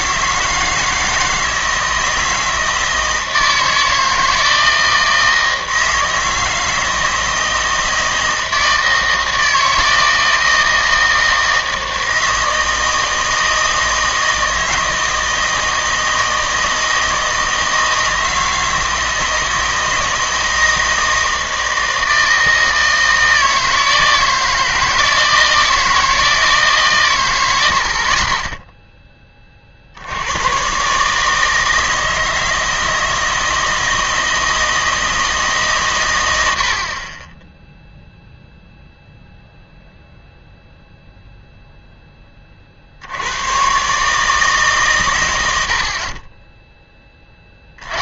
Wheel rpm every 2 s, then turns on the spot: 160, 160, 160, 160, 160, 160, 160, 160, 160, 160, 160, 160, 160, 150, 10, 130, 160, 160, 70, 0, 0, 40, 140, 10.
28-30